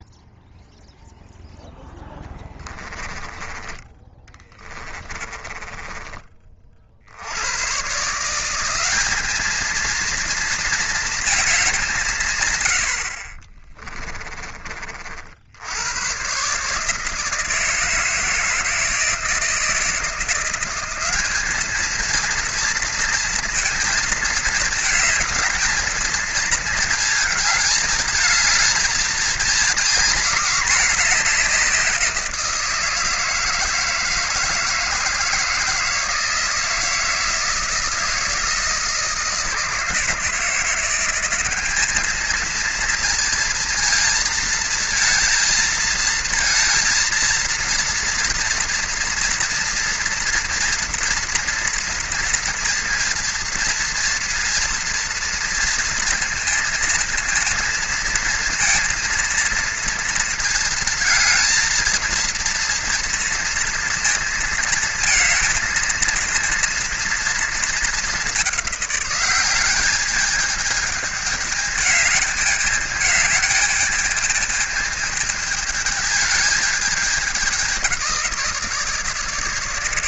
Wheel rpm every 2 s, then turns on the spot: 0, 10, 20, 30, 160, 220, 140, 20, 120, 160, 170, 230, 220, 220, 220, 230, 170, 160, 160, 160, 160, 220, 230, 230, 230, 230, 230, 230, 230, 230, 230, 230, 230, 230, 210, 210, 210, 210, 220, 170.
2-6